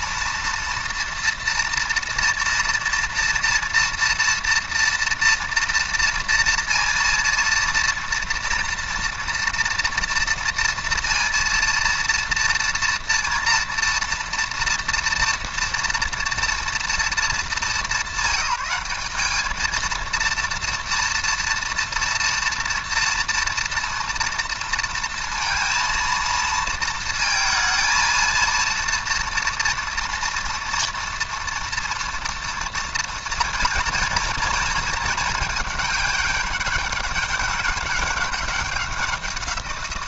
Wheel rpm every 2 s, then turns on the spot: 240, 240, 230, 230, 230, 230, 230, 240, 220, 200, 230, 230, 230, 230, 230, 230, 230, 230, 200, 200.
none